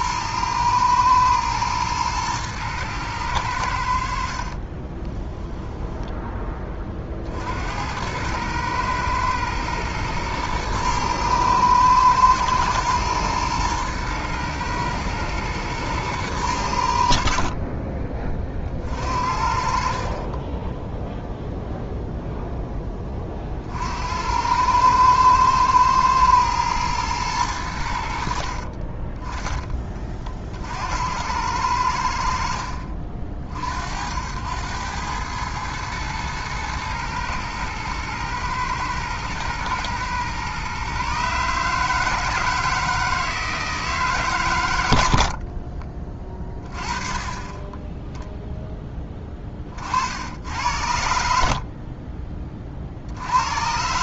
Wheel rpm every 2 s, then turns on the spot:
120, 110, 40, 20, 110, 110, 110, 120, 110, 40, 20, 0, 90, 110, 40, 60, 60, 90, 110, 120, 130, 160, 120, 20, 0, 80, 30.
4-6 28-30